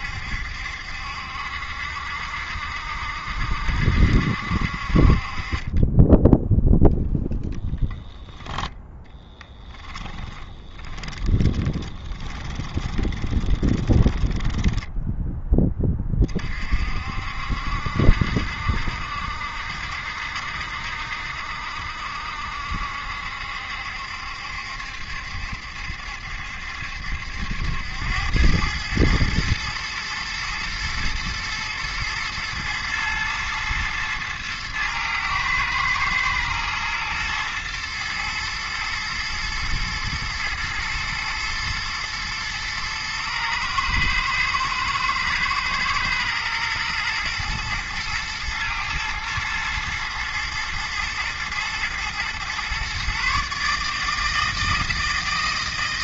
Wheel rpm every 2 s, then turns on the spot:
70, 60, 50, 0, 10, 20, 20, 10, 50, 70, 60, 70, 70, 70, 110, 110, 110, 110, 120, 110, 110, 110, 110, 110, 110, 110, 130, 160.
10-16